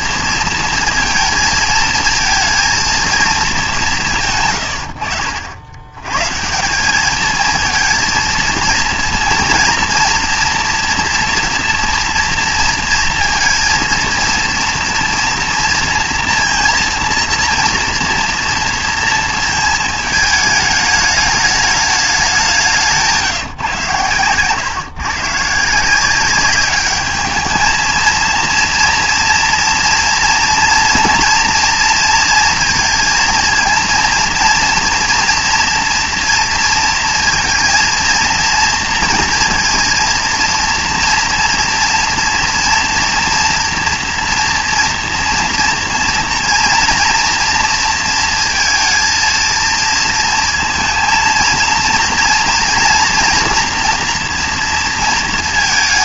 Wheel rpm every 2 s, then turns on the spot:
230, 230, 120, 180, 230, 240, 230, 230, 230, 230, 210, 190, 130, 200, 230, 230, 230, 230, 230, 230, 230, 230, 240, 230, 230, 230, 230, 230.
none